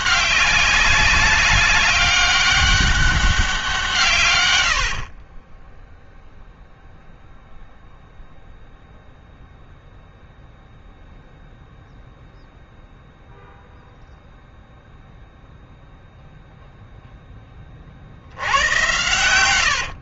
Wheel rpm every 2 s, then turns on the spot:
190, 200, 80, 0, 0, 0, 0, 0, 0, 90.
none